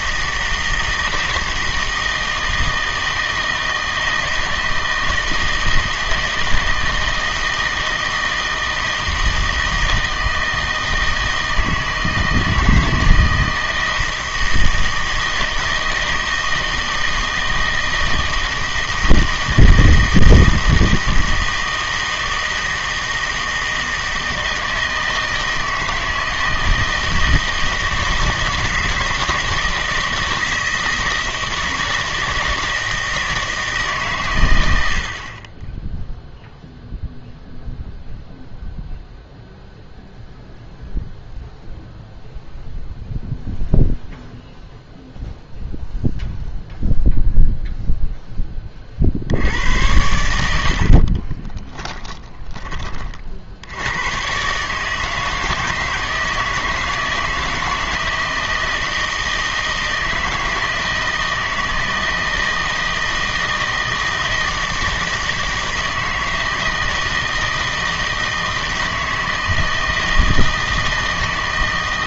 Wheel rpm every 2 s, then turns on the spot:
160, 160, 160, 160, 160, 160, 160, 160, 160, 160, 160, 160, 160, 160, 160, 160, 160, 100, 0, 0, 0, 0, 0, 0, 20, 70, 20, 140, 160, 160, 160, 160, 160, 160, 160, 160.
none